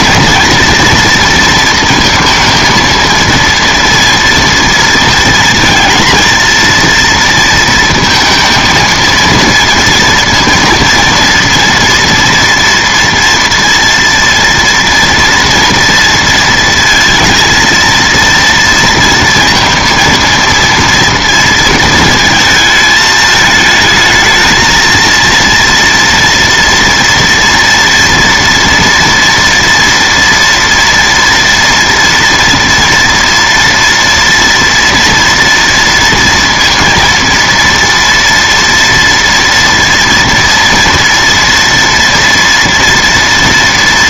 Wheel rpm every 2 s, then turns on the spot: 240, 230, 230, 230, 220, 230, 230, 230, 220, 230, 230, 220, 220, 230, 230, 230, 230, 230, 230, 230, 230, 230.
none